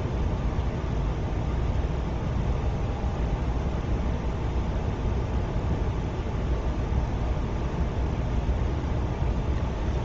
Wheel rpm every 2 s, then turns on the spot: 0, 0, 0, 0, 0.
none